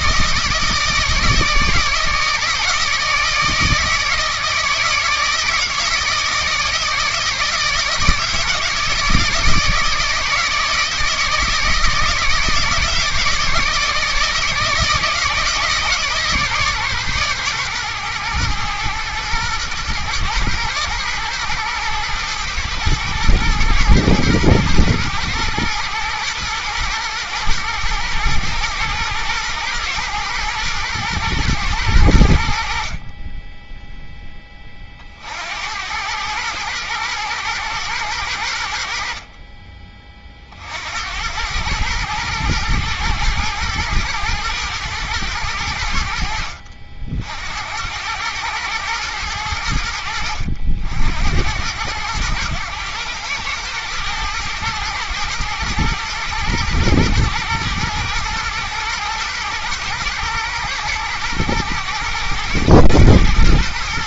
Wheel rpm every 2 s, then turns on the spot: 160, 160, 160, 160, 160, 160, 160, 160, 130, 110, 110, 110, 120, 120, 120, 110, 20, 70, 110, 40, 100, 110, 100, 60, 90, 80, 100, 110, 110, 110, 110, 110.
none